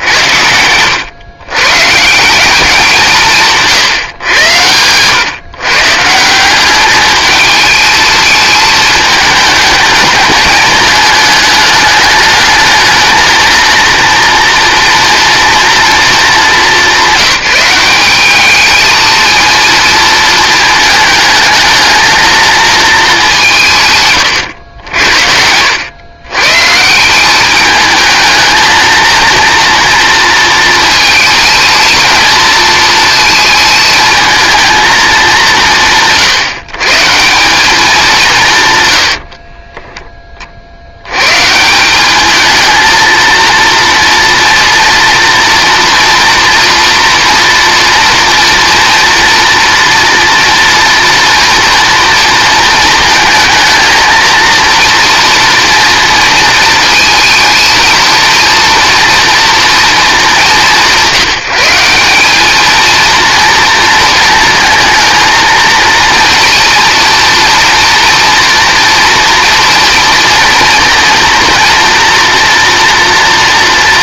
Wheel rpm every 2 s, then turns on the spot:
90, 200, 110, 190, 220, 220, 220, 230, 210, 210, 220, 220, 90, 140, 220, 220, 230, 230, 160, 150, 60, 220, 230, 230, 230, 230, 230, 230, 220, 230, 190, 210, 230, 230, 230, 230, 230.
4-6